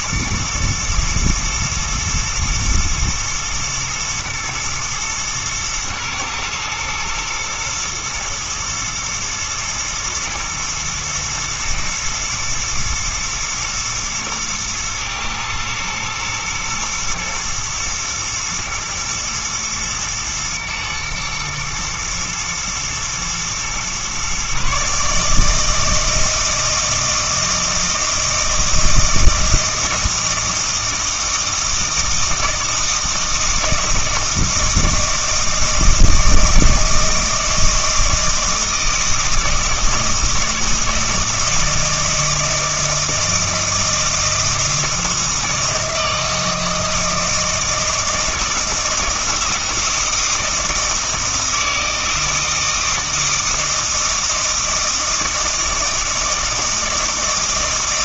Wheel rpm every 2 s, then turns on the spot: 110, 110, 120, 110, 110, 120, 110, 110, 110, 120, 110, 110, 140, 160, 160, 160, 160, 160, 160, 160, 160, 160, 160, 160, 160, 160, 160, 160, 160.
none